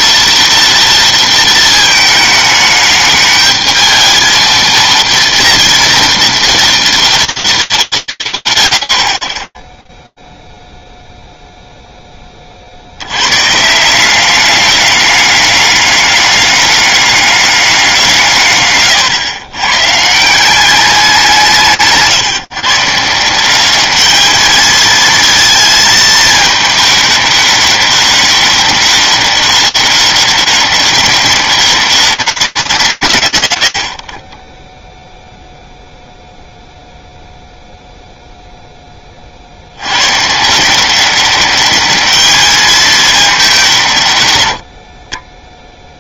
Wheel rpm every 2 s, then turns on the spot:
230, 220, 230, 230, 140, 0, 30, 190, 200, 150, 180, 160, 210, 220, 200, 190, 150, 10, 0, 30, 190, 210, 40.
none